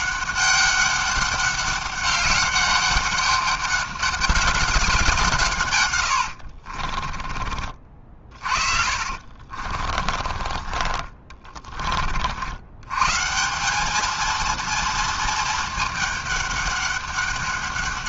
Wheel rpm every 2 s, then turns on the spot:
190, 200, 200, 50, 40, 40, 80, 220, 200.
6-12